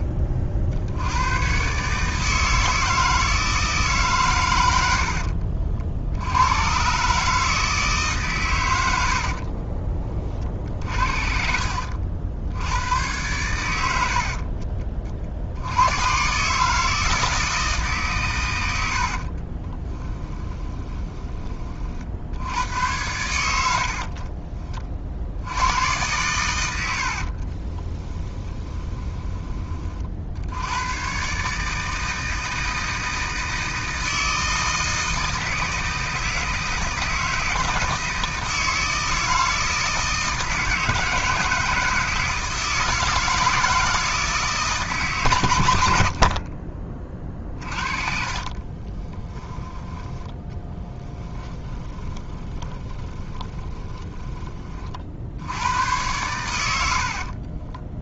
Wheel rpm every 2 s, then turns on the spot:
30, 160, 90, 130, 90, 50, 100, 40, 160, 80, 20, 90, 50, 80, 10, 110, 160, 160, 160, 160, 160, 160, 150, 30, 30, 10, 20, 40, 80.
10-12 18-22 26-30 46-54